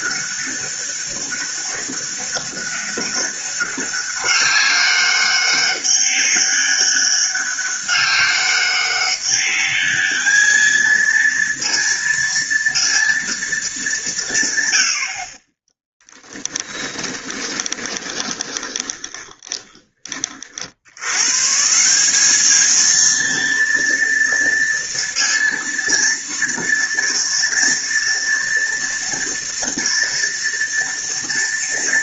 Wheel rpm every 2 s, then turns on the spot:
200, 200, 200, 200, 200, 220, 230, 70, 10, 20, 90, 220, 230, 230, 230, 230.
16-20